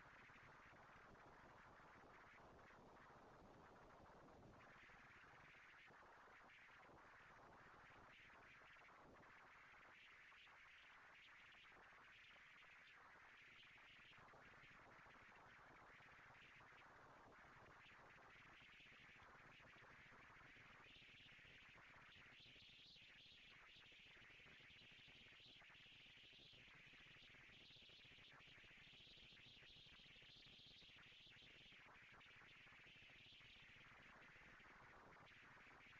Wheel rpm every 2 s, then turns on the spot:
230, 230, 230, 230, 230, 230, 240, 230, 220, 230, 230, 230, 230, 220, 230, 220, 180, 190.
none